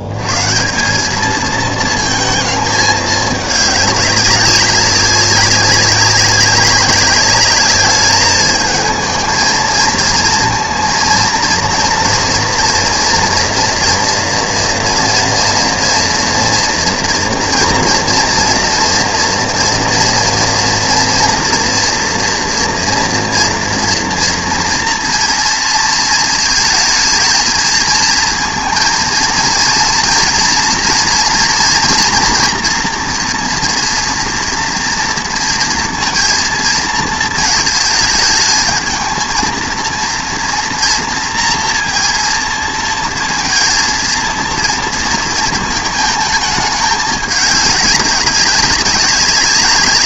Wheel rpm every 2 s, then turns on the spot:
110, 220, 190, 190, 220, 230, 240, 230, 230, 240, 230, 240, 230, 220, 230, 230, 230, 240, 230, 220, 230, 230, 230, 220, 200.
none